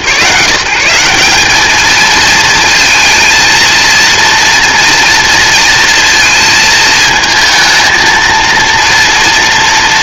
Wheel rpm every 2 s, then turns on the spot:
170, 230, 230, 220, 230.
none